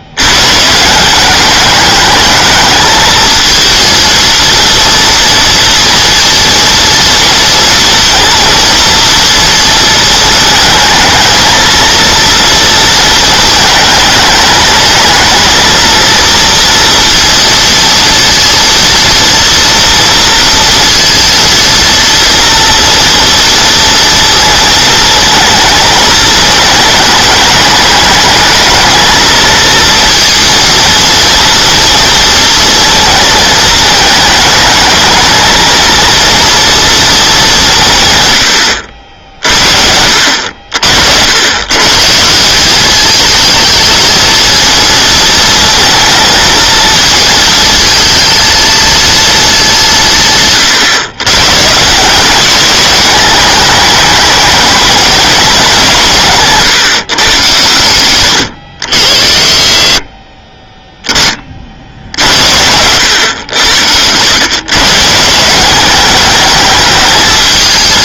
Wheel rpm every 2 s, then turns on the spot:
150, 220, 230, 230, 230, 220, 230, 220, 230, 230, 230, 230, 230, 220, 220, 230, 230, 220, 230, 80, 60, 190, 220, 230, 230, 140, 200, 210, 150, 70, 20, 80, 130, 210.
none